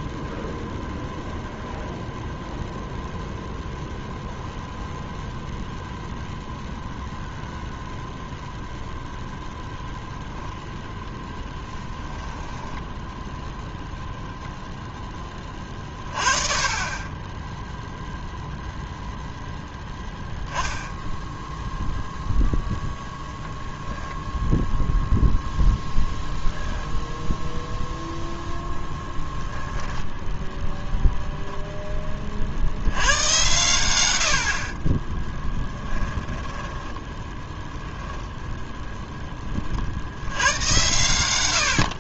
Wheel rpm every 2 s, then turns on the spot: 0, 0, 0, 0, 0, 0, 0, 30, 10, 0, 0, 0, 0, 0, 0, 0, 90, 10, 10, 20, 100.
34-36